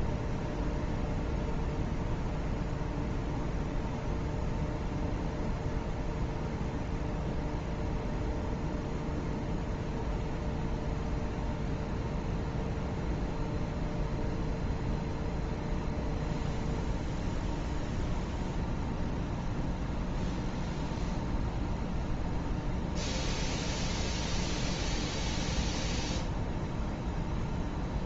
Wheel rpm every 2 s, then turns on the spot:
0, 0, 0, 0, 0, 0, 0, 0, 0, 0, 0, 0, 0, 0.
none